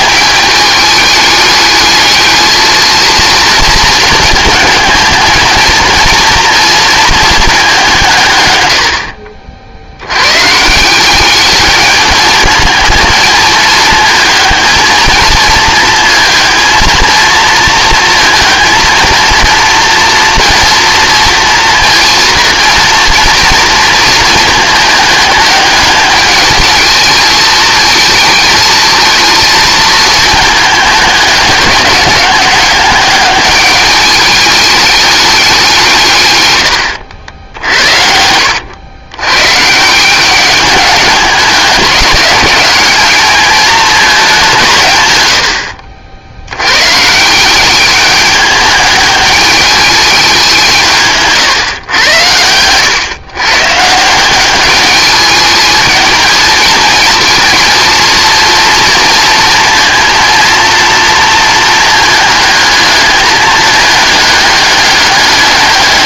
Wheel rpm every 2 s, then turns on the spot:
210, 220, 220, 230, 100, 150, 220, 220, 230, 230, 230, 230, 220, 220, 220, 210, 200, 210, 100, 100, 200, 200, 170, 100, 210, 180, 110, 200, 220, 230, 230, 220, 210.
none